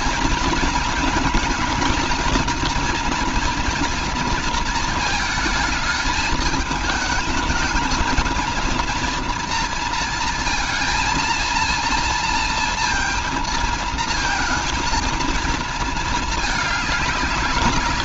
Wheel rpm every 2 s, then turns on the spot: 230, 230, 230, 220, 230, 230, 230, 220, 220.
none